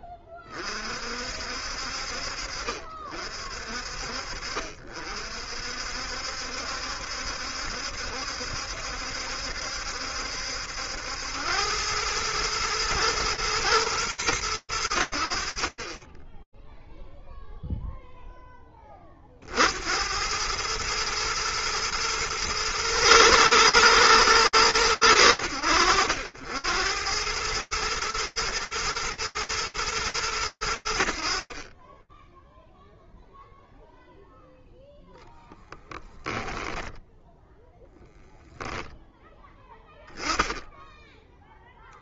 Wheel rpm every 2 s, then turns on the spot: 30, 50, 50, 70, 70, 70, 110, 100, 10, 10, 100, 120, 110, 90, 110, 100, 0, 10, 10, 0, 10.
none